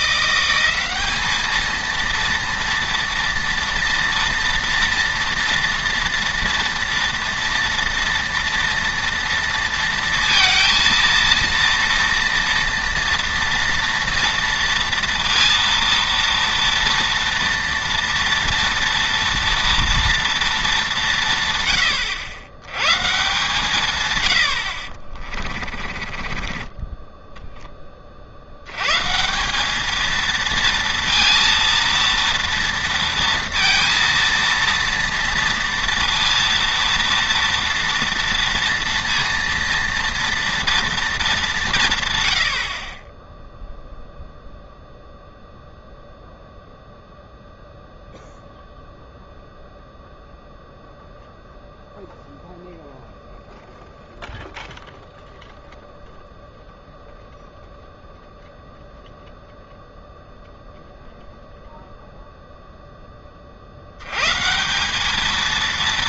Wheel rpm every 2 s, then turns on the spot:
190, 230, 230, 230, 230, 230, 230, 230, 230, 230, 210, 110, 70, 20, 110, 230, 230, 230, 230, 230, 230, 50, 0, 0, 0, 0, 0, 0, 0, 0, 0, 0, 170.
26-28